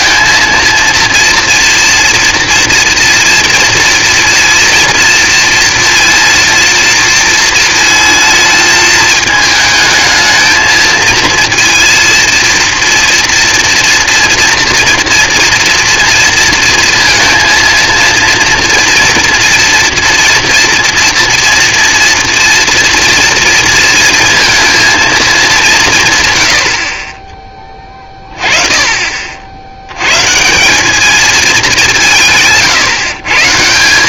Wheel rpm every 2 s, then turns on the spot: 230, 230, 230, 230, 220, 220, 230, 230, 230, 230, 230, 230, 230, 70, 30, 180, 150.
none